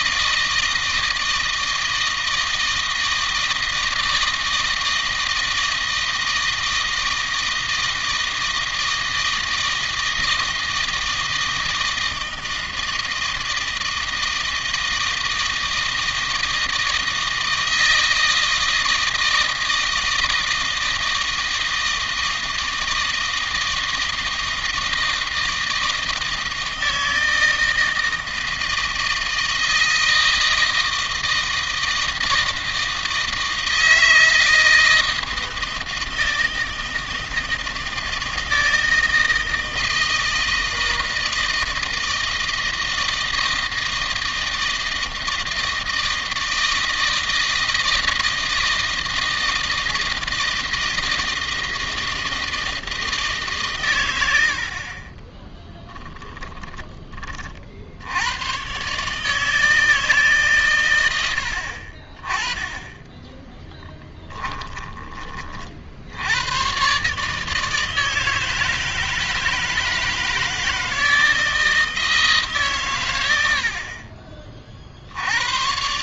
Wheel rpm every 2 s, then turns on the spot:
160, 160, 160, 160, 160, 160, 160, 160, 160, 160, 160, 160, 160, 160, 160, 160, 160, 160, 160, 160, 160, 160, 160, 160, 160, 160, 160, 40, 20, 140, 110, 10, 20, 130, 160, 160, 120, 60.
54-56 62-64